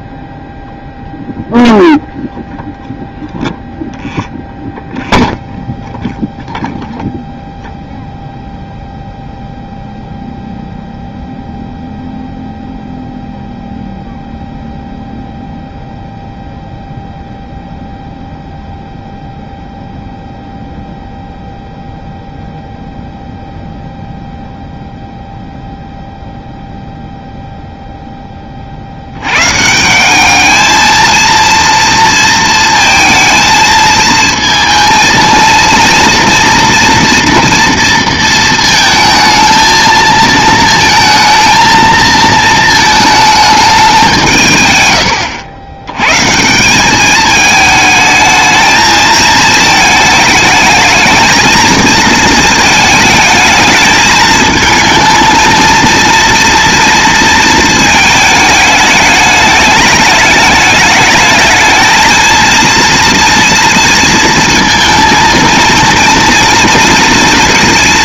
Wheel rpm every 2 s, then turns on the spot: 0, 0, 0, 0, 0, 0, 0, 0, 0, 0, 0, 0, 0, 0, 50, 220, 230, 230, 230, 220, 220, 220, 120, 190, 220, 210, 220, 220, 230, 210, 210, 230, 230, 230.
none